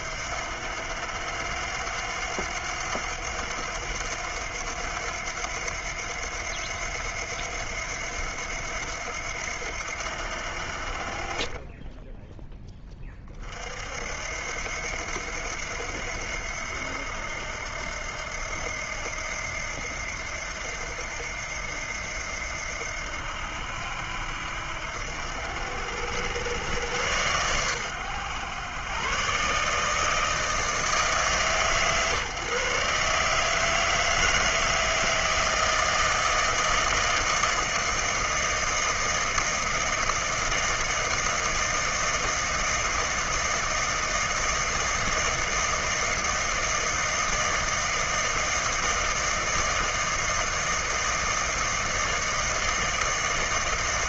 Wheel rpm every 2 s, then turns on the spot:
80, 90, 90, 90, 80, 70, 10, 80, 80, 80, 80, 80, 80, 100, 110, 160, 150, 160, 160, 160, 160, 160, 160, 160, 160, 160, 160.
none